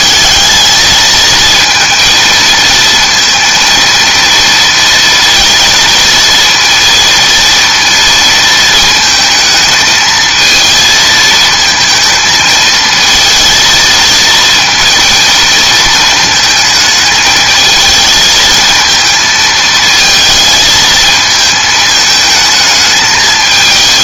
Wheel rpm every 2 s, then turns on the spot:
220, 230, 230, 230, 220, 220, 220, 230, 220, 220, 220, 220.
none